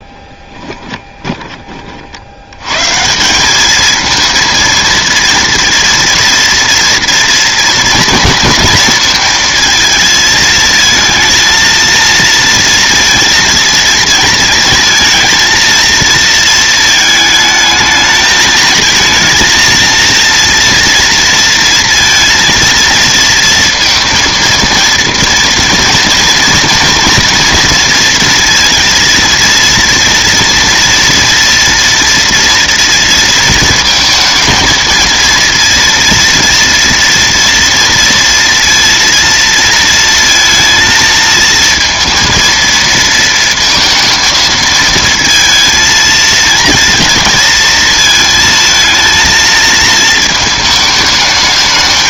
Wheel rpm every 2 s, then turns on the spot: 20, 150, 230, 230, 230, 220, 230, 230, 220, 220, 230, 230, 230, 230, 230, 230, 230, 230, 240, 230, 220, 230, 220, 230, 220, 220.
0-2